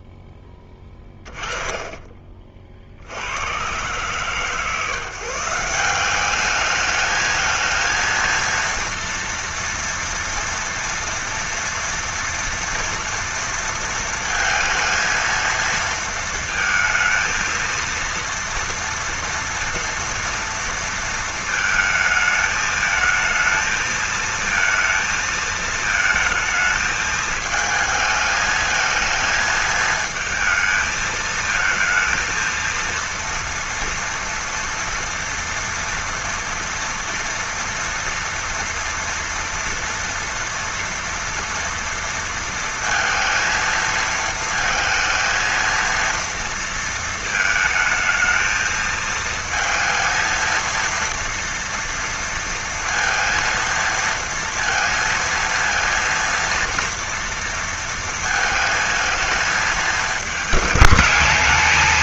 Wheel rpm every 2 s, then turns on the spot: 10, 40, 140, 210, 230, 230, 230, 230, 230, 230, 230, 220, 230, 220, 220, 220, 230, 230, 230, 230, 230, 230, 230, 230, 220, 230, 230, 230, 230, 220, 220.
none